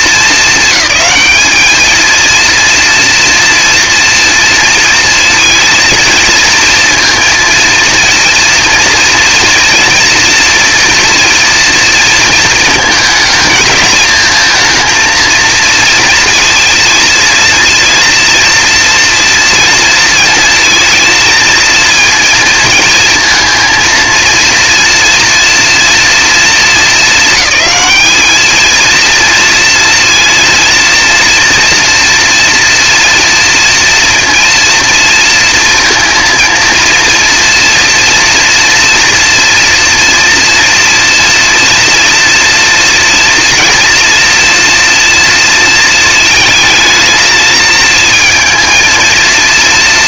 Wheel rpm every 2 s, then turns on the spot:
200, 230, 230, 230, 230, 240, 220, 230, 230, 230, 230, 230, 230, 220, 230, 230, 230, 230, 230, 240, 240, 240, 230, 220, 230.
none